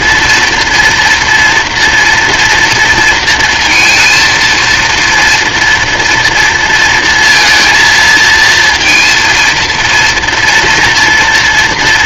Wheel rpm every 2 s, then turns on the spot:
230, 230, 230, 230, 230, 240.
none